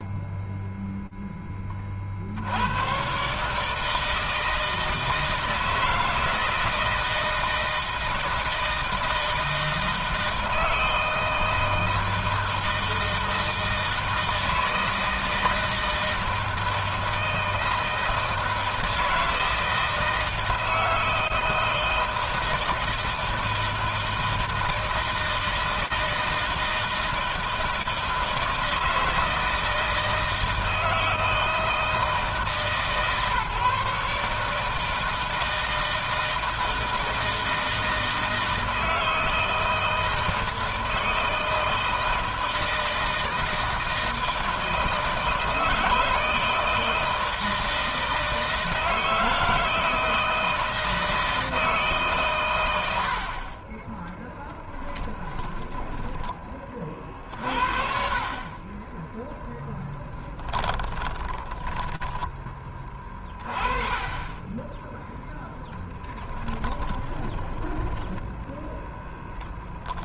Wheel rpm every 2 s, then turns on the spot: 0, 110, 160, 160, 160, 160, 160, 160, 160, 160, 160, 160, 160, 160, 160, 160, 140, 160, 160, 160, 160, 160, 160, 160, 160, 160, 100, 20, 30, 10, 10, 20, 10, 10, 0.
54-56 60-62 66-68